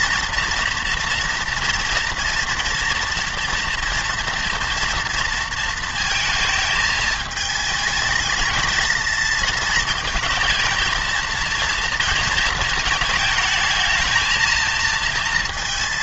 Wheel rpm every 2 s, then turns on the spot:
230, 230, 230, 220, 220, 230, 220, 230.
none